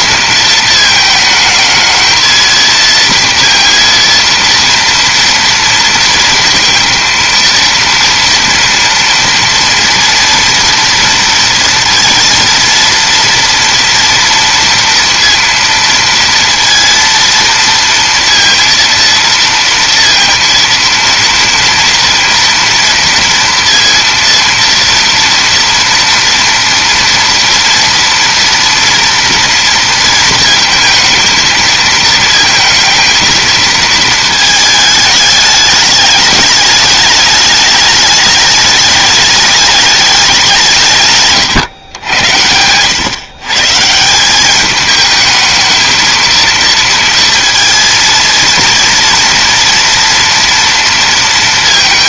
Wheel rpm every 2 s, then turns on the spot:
220, 230, 230, 230, 230, 230, 230, 230, 230, 230, 230, 230, 230, 230, 230, 230, 230, 220, 210, 210, 160, 100, 210, 230, 230, 230.
none